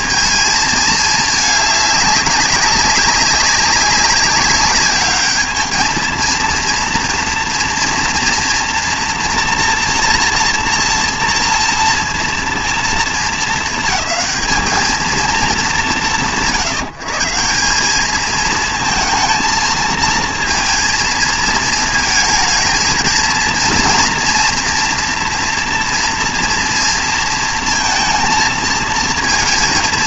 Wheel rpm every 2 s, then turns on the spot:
220, 190, 200, 230, 230, 240, 230, 220, 150, 220, 220, 220, 240, 230, 230.
none